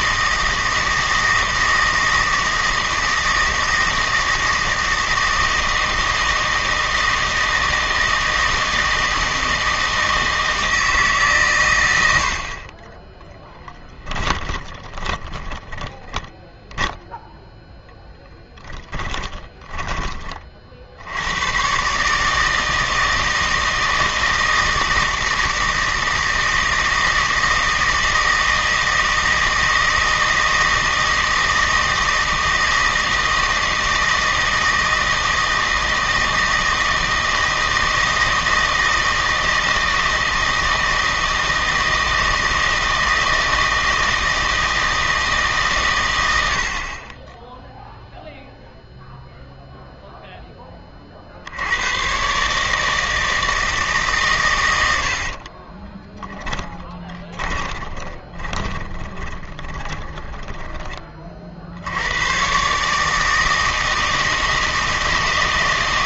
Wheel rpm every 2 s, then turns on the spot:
160, 160, 160, 160, 160, 160, 30, 20, 0, 10, 50, 160, 160, 160, 160, 160, 160, 160, 160, 160, 160, 160, 160, 70, 0, 10, 150, 100, 10, 20, 20, 140, 160.
14-16 18-20 56-60